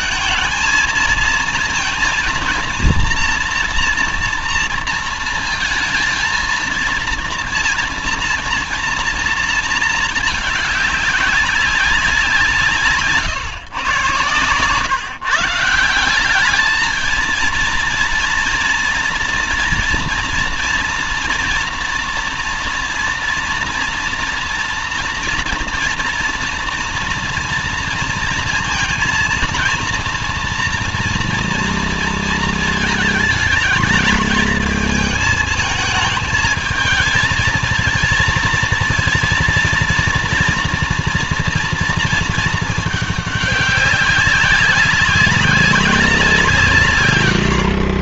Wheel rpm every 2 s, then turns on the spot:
220, 230, 230, 230, 230, 200, 150, 140, 220, 230, 230, 230, 230, 240, 230, 230, 220, 220, 220, 230, 240, 210, 190, 120.
none